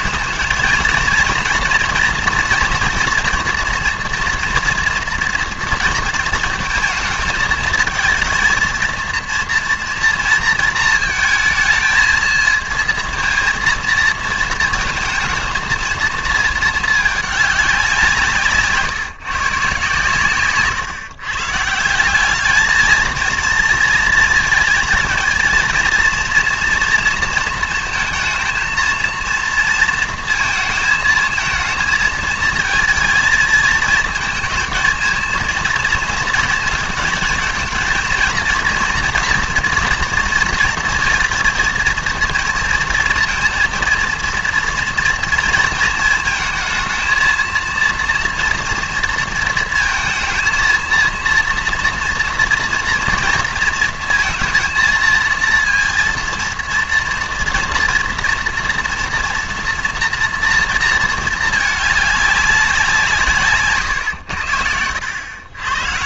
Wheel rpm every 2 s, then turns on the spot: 230, 230, 230, 230, 230, 230, 220, 230, 220, 150, 140, 210, 220, 230, 220, 230, 230, 230, 220, 230, 230, 230, 240, 220, 230, 220, 230, 230, 230, 230, 230, 190, 90.
none